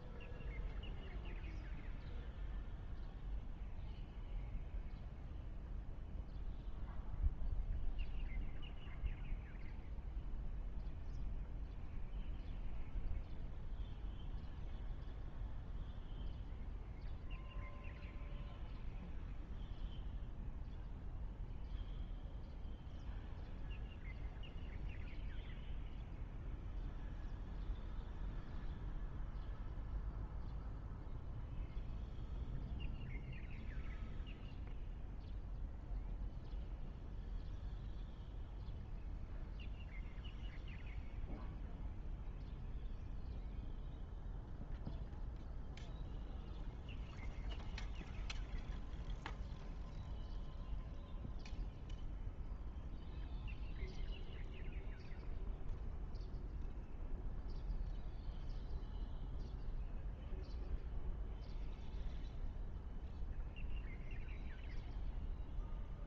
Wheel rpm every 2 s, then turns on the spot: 0, 0, 0, 0, 0, 0, 0, 0, 0, 0, 0, 0, 0, 0, 0, 0, 0, 0, 0, 0, 0, 0, 0, 0, 0, 0, 0, 0, 0, 0, 0, 0, 0.
none